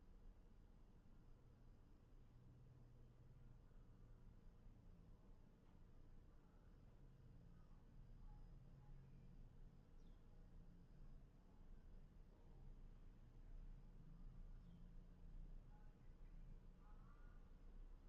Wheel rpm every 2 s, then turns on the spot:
0, 0, 0, 0, 0, 0, 0, 0, 0.
none